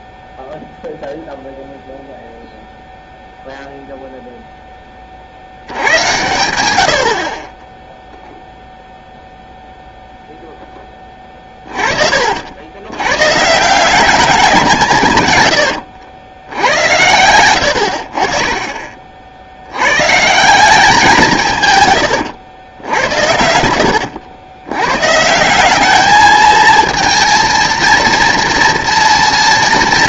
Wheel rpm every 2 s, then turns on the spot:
0, 0, 10, 80, 0, 10, 90, 170, 90, 30, 170, 90, 100, 230, 230.
22-24